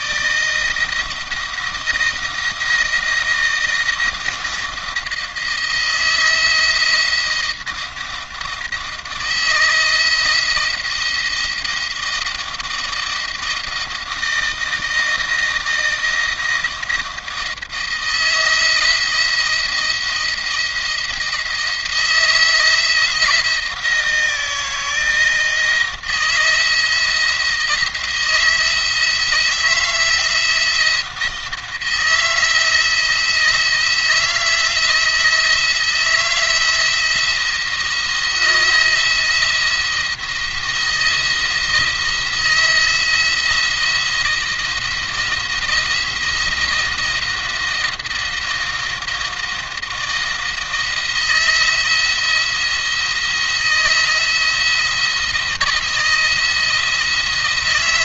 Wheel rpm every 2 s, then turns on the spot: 160, 170, 170, 170, 160, 170, 160, 160, 160, 170, 170, 170, 170, 170, 170, 170, 160, 160, 170, 170, 170, 160, 160, 170, 170, 170, 170, 160, 160.
none